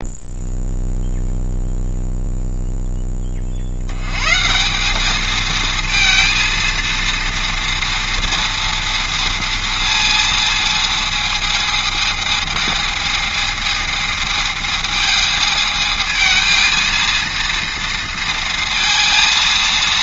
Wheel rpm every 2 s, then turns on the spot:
0, 0, 160, 230, 230, 230, 220, 220, 220, 230.
none